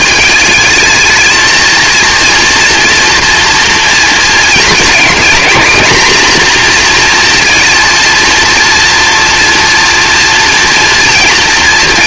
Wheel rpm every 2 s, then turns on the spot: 220, 230, 220, 240, 230, 240.
none